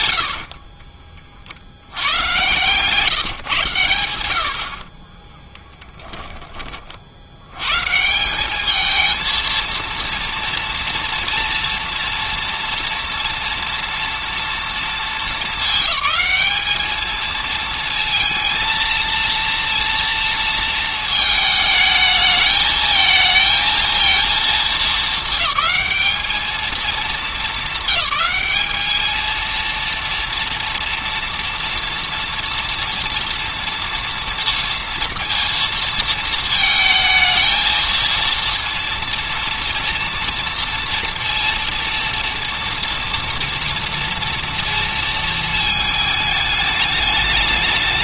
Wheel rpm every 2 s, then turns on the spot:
40, 140, 40, 50, 220, 230, 230, 220, 210, 220, 230, 220, 210, 230, 220, 230, 230, 230, 220, 230, 230, 230, 230, 210.
0-2 4-6